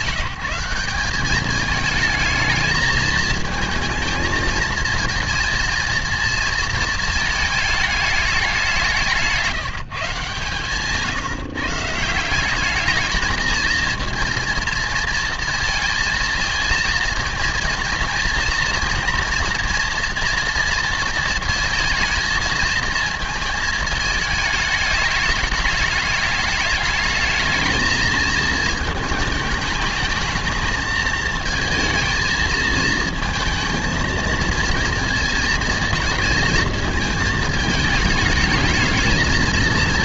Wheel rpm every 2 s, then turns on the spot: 180, 220, 220, 230, 200, 140, 190, 230, 220, 240, 230, 220, 210, 210, 220, 220, 220, 230, 230, 220.
none